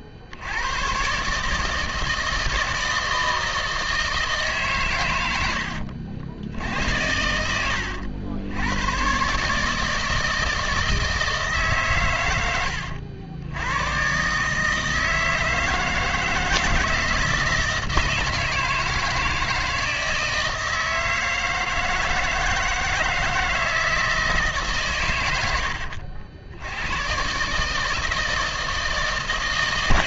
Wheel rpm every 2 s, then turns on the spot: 90, 160, 140, 90, 90, 160, 100, 150, 170, 160, 160, 160, 150, 90, 160.
none